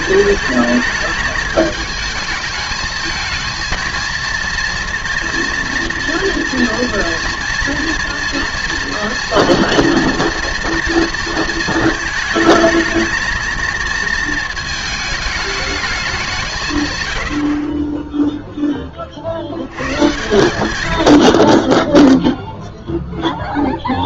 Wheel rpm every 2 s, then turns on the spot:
210, 220, 230, 230, 230, 230, 220, 220, 130, 10, 110, 0.
none